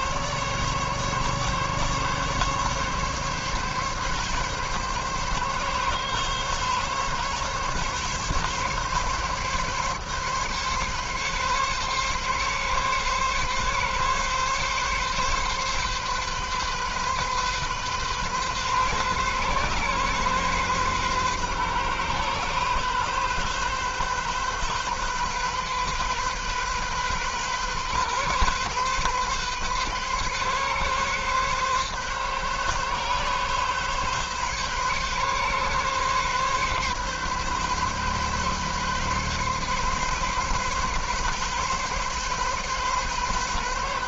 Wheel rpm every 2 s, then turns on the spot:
140, 140, 140, 130, 140, 140, 140, 140, 130, 130, 130, 130, 130, 130, 130, 140, 140, 130, 140, 140, 140, 130.
none